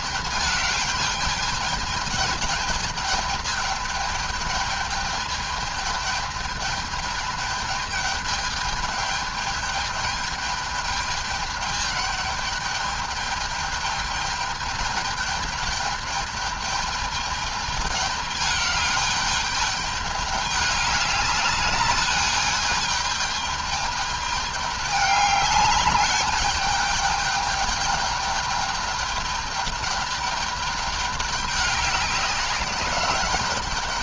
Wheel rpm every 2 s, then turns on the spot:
210, 210, 210, 210, 210, 210, 210, 210, 210, 210, 200, 210, 210, 210, 210, 200, 190.
none